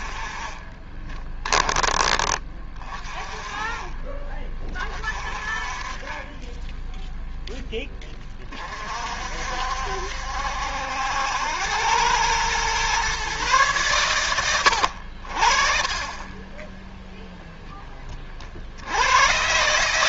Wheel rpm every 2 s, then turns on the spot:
30, 30, 30, 10, 40, 70, 120, 80, 10, 50.
0-2 16-18